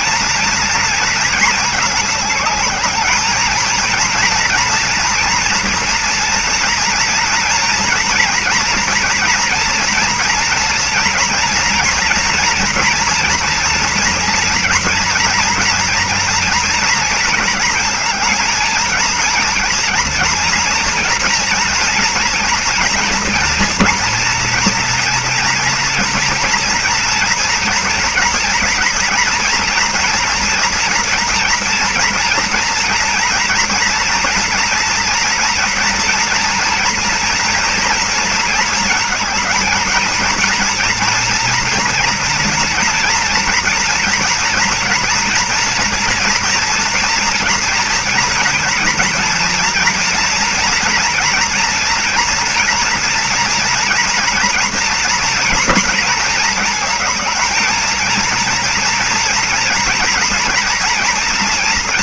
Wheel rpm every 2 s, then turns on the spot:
230, 210, 230, 230, 240, 230, 230, 230, 230, 230, 230, 230, 240, 230, 230, 230, 240, 230, 230, 230, 230, 230, 230, 230, 240, 240, 230, 230, 230, 230, 240.
none